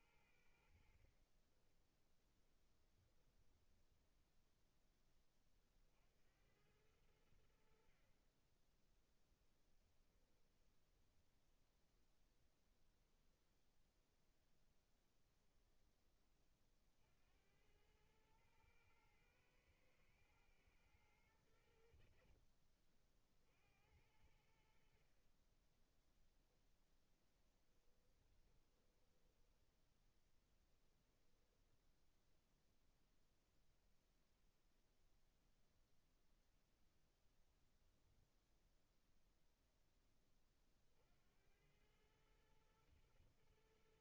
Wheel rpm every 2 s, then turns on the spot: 90, 10, 10, 80, 30, 10, 10, 0, 10, 110, 110, 60, 80, 10, 20, 10, 0, 0, 0, 0, 10, 110.
2-6 10-12 22-24 28-30